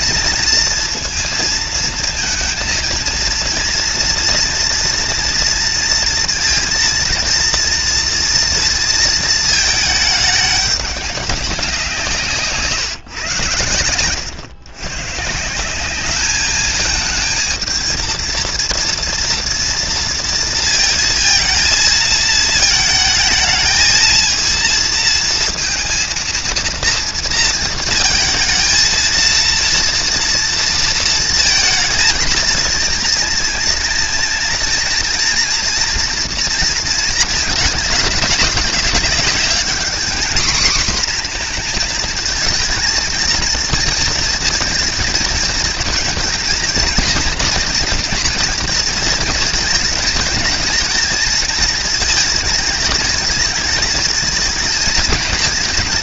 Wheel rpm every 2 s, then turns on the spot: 230, 230, 240, 230, 230, 200, 150, 110, 210, 230, 230, 220, 230, 230, 220, 230, 230, 230, 230, 200, 240, 220, 230, 230, 230, 220, 220, 220.
none